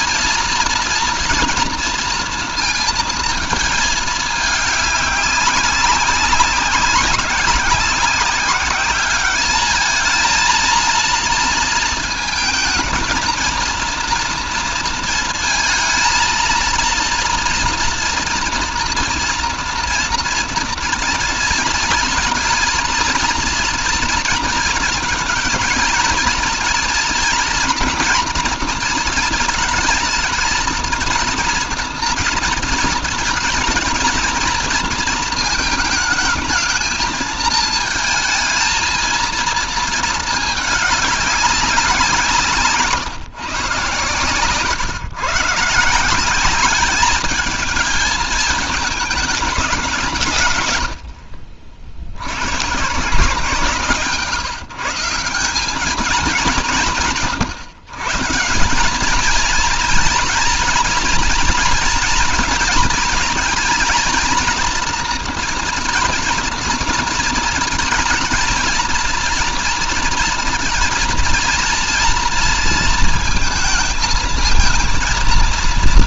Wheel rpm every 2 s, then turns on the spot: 240, 230, 200, 190, 200, 230, 230, 230, 230, 230, 230, 230, 230, 230, 230, 230, 230, 230, 230, 230, 200, 140, 140, 210, 220, 70, 150, 170, 150, 210, 230, 220, 230, 230, 230, 230, 230, 230.
none